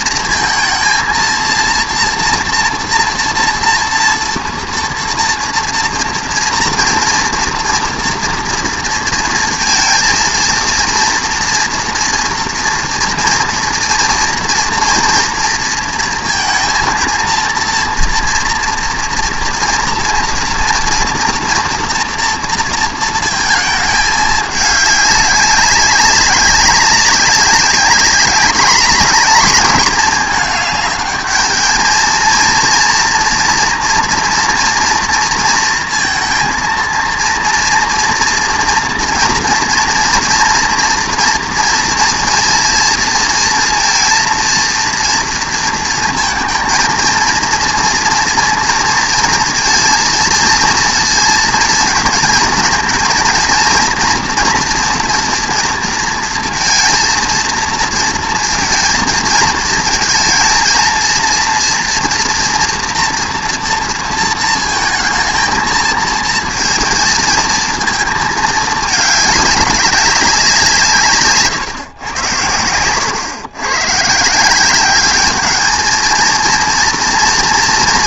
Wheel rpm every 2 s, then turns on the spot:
230, 230, 240, 230, 230, 230, 230, 230, 230, 230, 240, 230, 210, 200, 210, 210, 230, 230, 230, 230, 240, 230, 230, 230, 230, 230, 230, 240, 230, 220, 230, 230, 220, 230, 220, 170, 100, 190, 230.
none